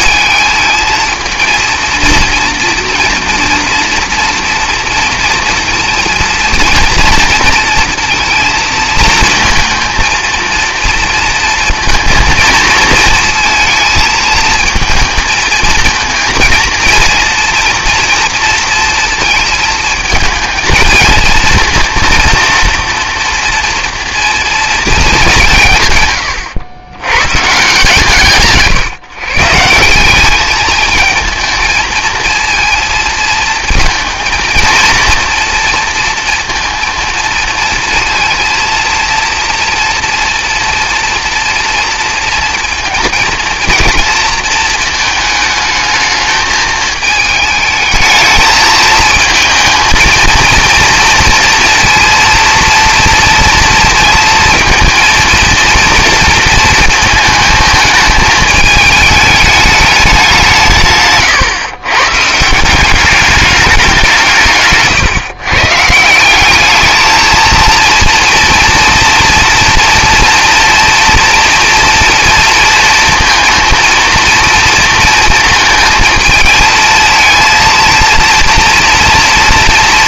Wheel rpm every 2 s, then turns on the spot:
230, 230, 230, 230, 230, 230, 220, 220, 230, 230, 220, 240, 220, 90, 150, 220, 230, 220, 230, 230, 230, 230, 220, 220, 220, 230, 230, 230, 230, 220, 170, 170, 150, 210, 230, 230, 230, 230, 230, 230.
none